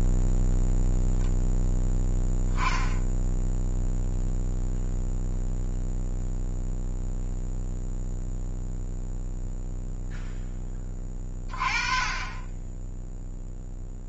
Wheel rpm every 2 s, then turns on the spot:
0, 10, 0, 0, 0, 20, 10.
none